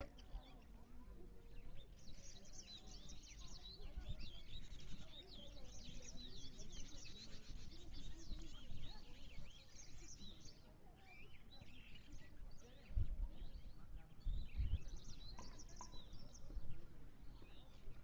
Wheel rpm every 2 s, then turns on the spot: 0, 0, 0, 0, 0, 0, 0, 0, 0.
none